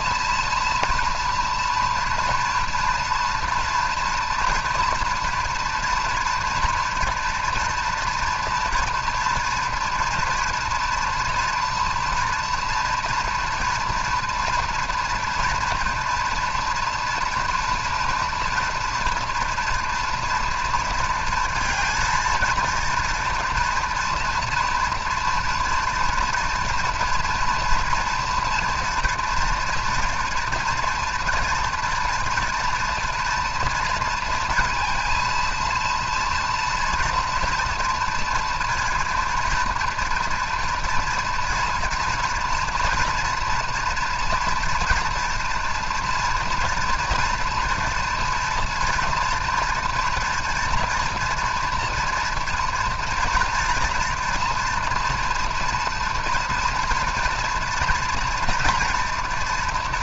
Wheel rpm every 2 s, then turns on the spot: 230, 230, 230, 230, 230, 240, 240, 230, 230, 230, 230, 230, 230, 230, 240, 230, 230, 230, 230, 230, 230, 230, 230, 230, 230, 230, 230, 240, 230, 230.
none